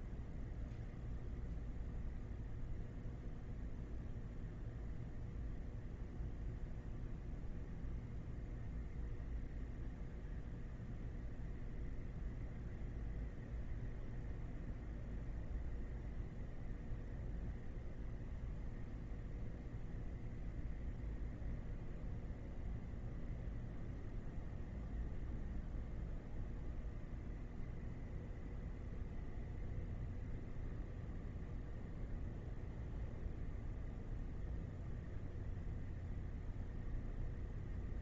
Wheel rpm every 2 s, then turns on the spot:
0, 0, 0, 0, 0, 0, 0, 0, 0, 0, 0, 0, 0, 0, 0, 0, 0, 0, 0.
none